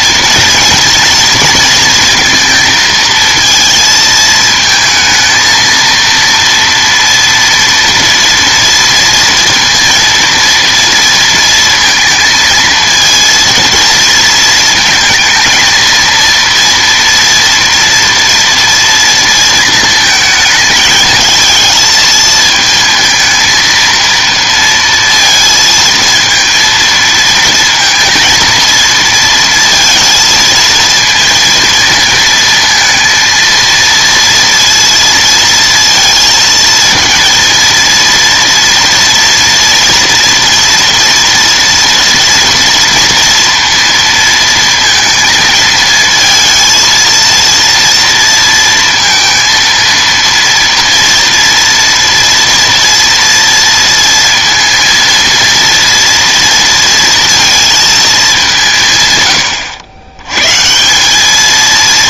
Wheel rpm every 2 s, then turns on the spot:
230, 230, 220, 230, 230, 230, 220, 220, 230, 230, 220, 220, 230, 230, 230, 230, 220, 230, 220, 230, 240, 230, 230, 230, 230, 230, 230, 230, 230, 170, 140.
none